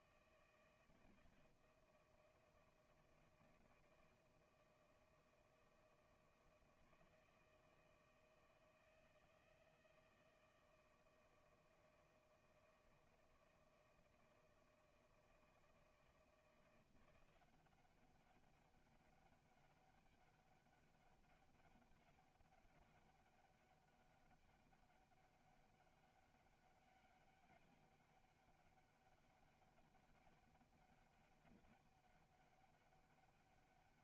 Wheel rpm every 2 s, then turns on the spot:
160, 160, 160, 160, 160, 160, 160, 160, 170, 200, 200, 200, 200, 190, 200, 200, 200.
none